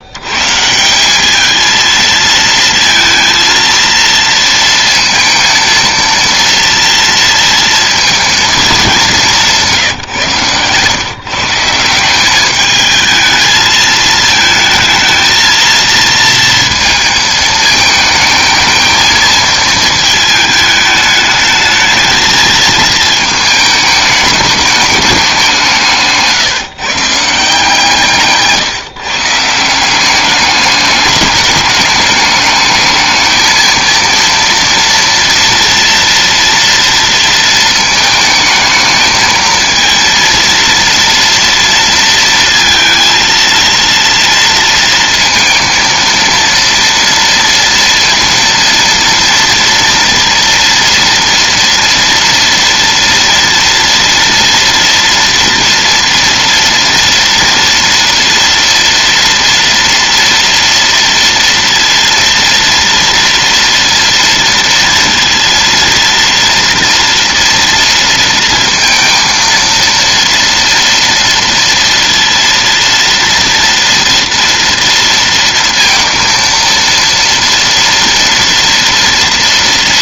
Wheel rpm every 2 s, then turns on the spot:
180, 230, 230, 230, 200, 130, 220, 220, 220, 220, 210, 220, 200, 150, 150, 200, 220, 230, 230, 220, 230, 230, 230, 230, 230, 230, 230, 230, 230, 230, 230, 230, 230, 240, 230, 230, 230, 230, 230, 230.
none